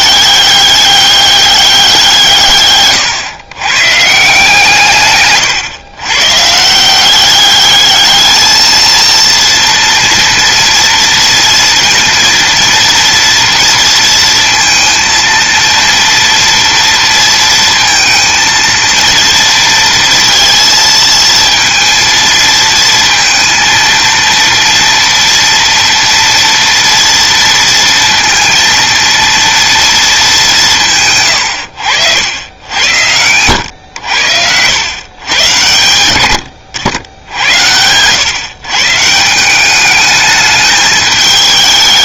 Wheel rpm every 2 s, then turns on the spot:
200, 120, 140, 180, 230, 230, 230, 230, 230, 230, 230, 230, 230, 230, 230, 130, 90, 110, 90, 150, 210.
2-4